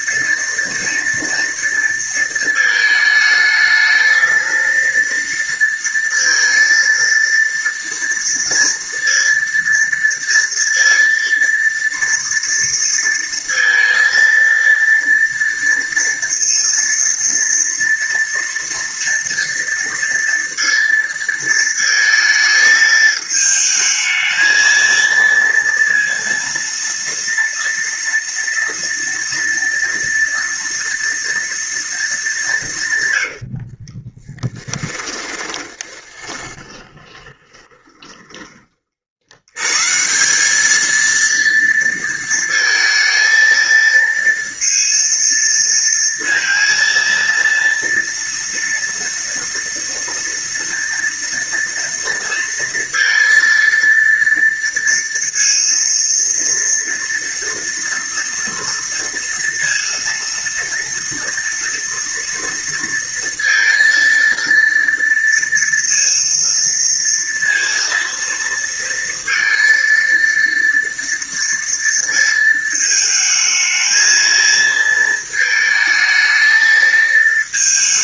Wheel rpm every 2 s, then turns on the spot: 230, 230, 220, 230, 230, 230, 230, 230, 230, 240, 230, 220, 220, 230, 230, 230, 200, 10, 20, 20, 170, 230, 230, 230, 230, 230, 230, 230, 230, 230, 230, 230, 230, 230, 230, 230, 230, 220, 220.
34-40